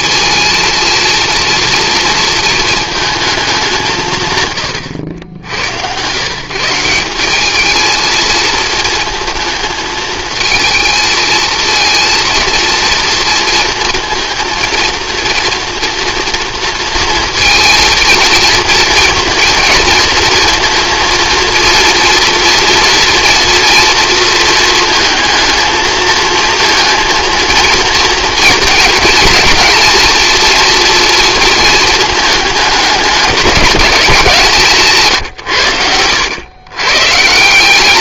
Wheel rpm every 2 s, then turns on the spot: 230, 220, 90, 170, 220, 220, 230, 230, 230, 230, 230, 230, 220, 230, 230, 230, 210, 150, 130.
34-36